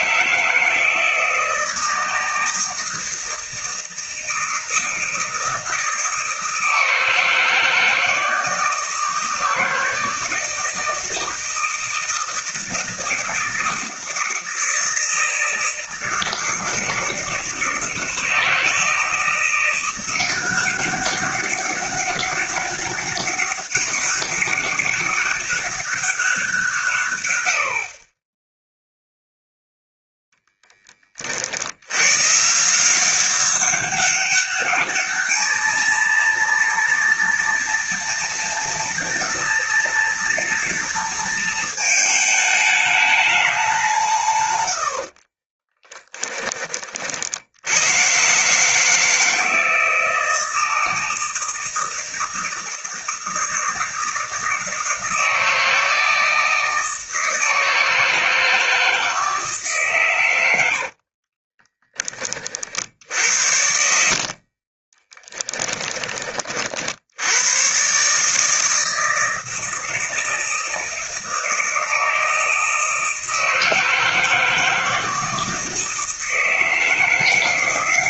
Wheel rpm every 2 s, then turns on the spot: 160, 160, 160, 160, 160, 160, 160, 160, 160, 160, 190, 200, 200, 160, 0, 10, 160, 210, 230, 230, 230, 210, 90, 40, 150, 160, 160, 160, 160, 160, 80, 50, 40, 60, 160, 160, 160, 160, 160.
60-62 64-66